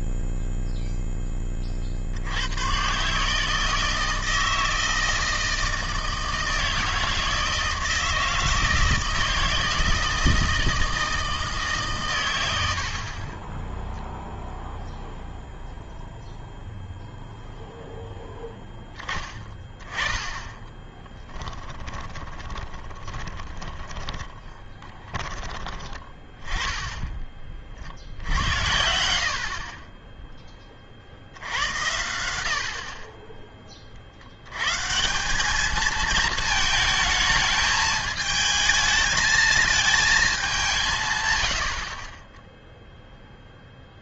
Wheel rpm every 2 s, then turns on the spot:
0, 60, 160, 160, 160, 160, 130, 0, 0, 10, 10, 20, 20, 20, 80, 20, 60, 120, 220, 220, 190, 0.
20-26